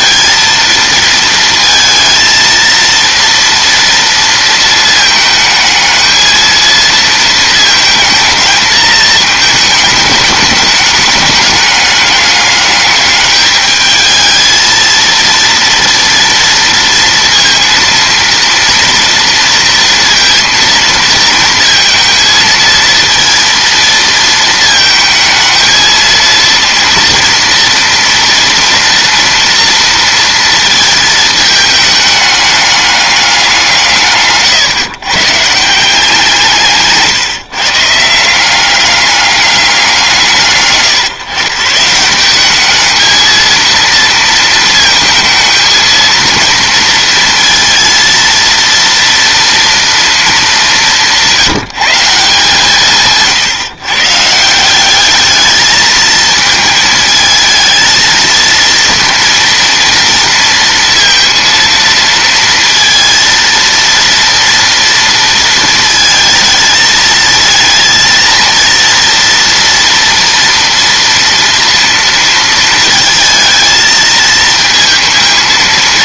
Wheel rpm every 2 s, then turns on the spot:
230, 230, 230, 220, 220, 210, 210, 220, 230, 230, 230, 220, 220, 230, 230, 230, 210, 140, 170, 190, 130, 200, 230, 230, 230, 210, 160, 170, 230, 230, 230, 230, 230, 220, 230, 230, 230, 220.
none